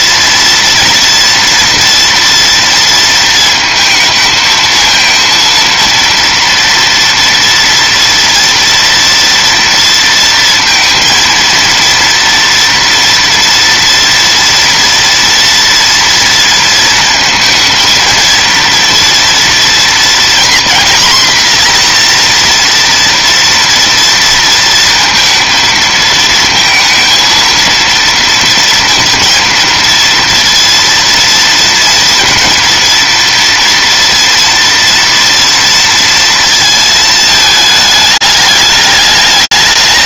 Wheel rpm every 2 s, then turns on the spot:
240, 230, 230, 240, 230, 230, 230, 230, 230, 230, 250, 230, 230, 230, 230, 230, 230, 230, 220, 180.
none